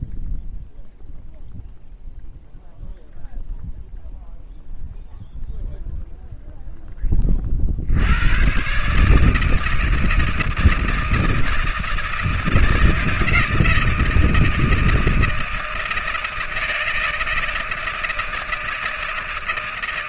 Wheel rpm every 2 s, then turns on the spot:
0, 0, 0, 30, 160, 160, 160, 160, 160, 160.
none